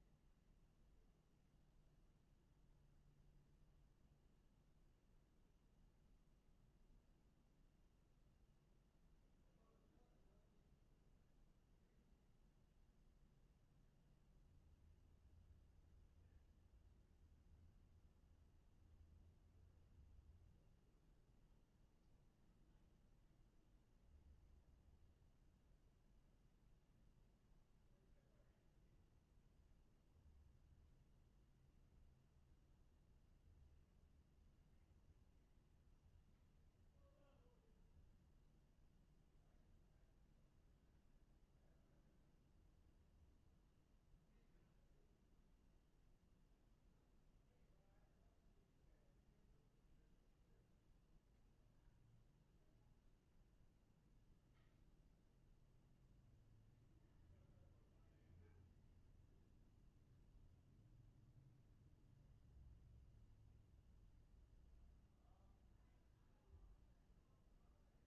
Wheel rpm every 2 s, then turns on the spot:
0, 0, 0, 0, 0, 0, 0, 0, 0, 0, 0, 0, 0, 0, 0, 0, 0, 0, 0, 0, 0, 0, 0, 0, 0, 0, 0, 0, 0, 0, 0, 0, 0, 0.
none